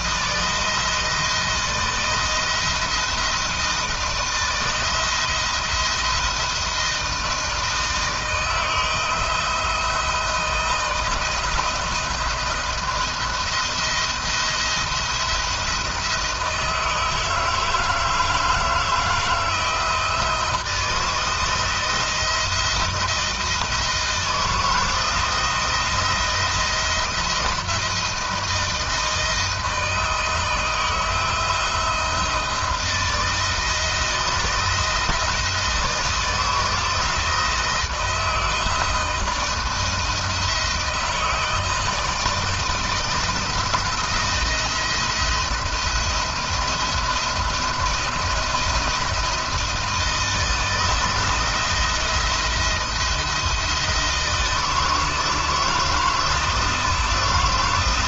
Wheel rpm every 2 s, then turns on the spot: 160, 170, 170, 160, 160, 170, 170, 170, 160, 160, 170, 170, 170, 170, 160, 160, 160, 160, 170, 160, 160, 170, 170, 170, 170, 160, 170, 160, 160.
none